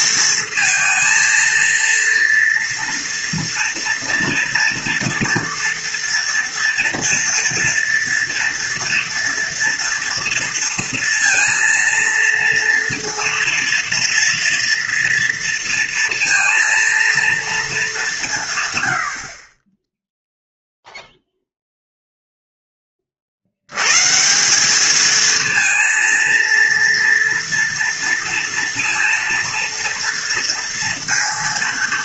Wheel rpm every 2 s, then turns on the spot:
220, 230, 230, 230, 230, 230, 230, 230, 230, 150, 0, 10, 190, 240, 230, 230.
none